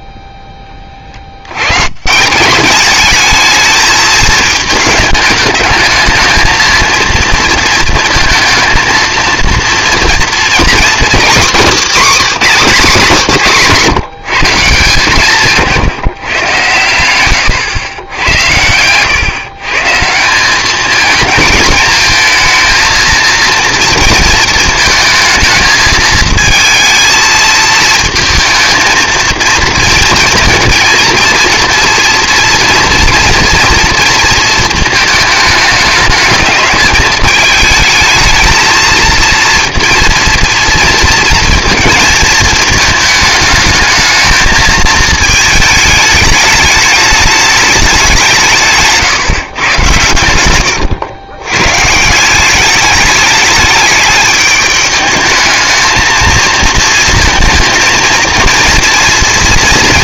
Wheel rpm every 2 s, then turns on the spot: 20, 190, 220, 230, 220, 250, 260, 150, 110, 110, 210, 220, 220, 230, 230, 230, 230, 220, 220, 230, 230, 220, 220, 210, 150, 100, 200, 210, 230, 230.
50-52